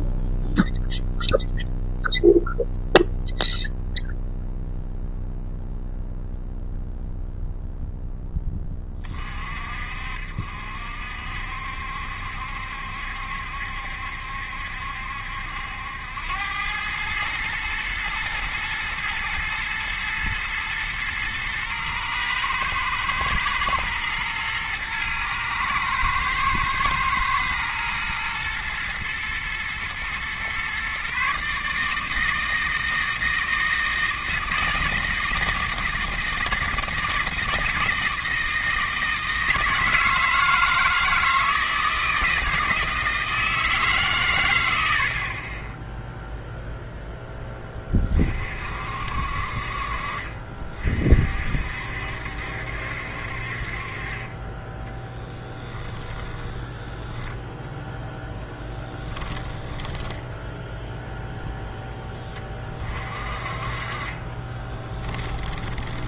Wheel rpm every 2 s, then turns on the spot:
0, 0, 0, 0, 20, 60, 70, 70, 100, 120, 120, 110, 110, 110, 120, 130, 160, 160, 160, 160, 160, 160, 90, 0, 50, 40, 70, 20, 10, 10, 0, 30, 20.
56-60 64-66